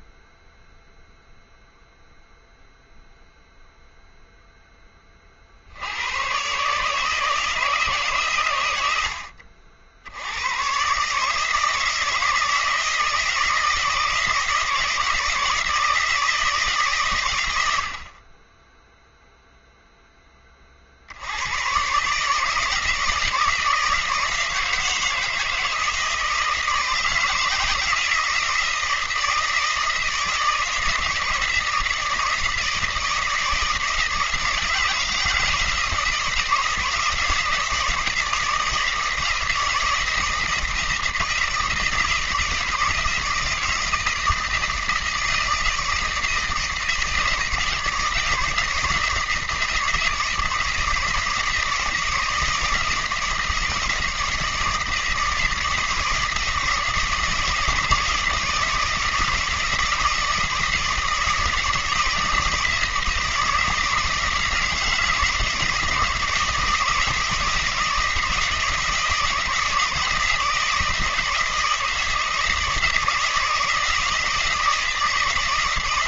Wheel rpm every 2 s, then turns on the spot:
0, 0, 10, 140, 110, 130, 160, 160, 150, 10, 40, 160, 160, 160, 160, 160, 160, 160, 170, 160, 160, 160, 160, 160, 160, 160, 160, 160, 160, 160, 160, 160, 160, 160, 160, 160, 160, 160.
none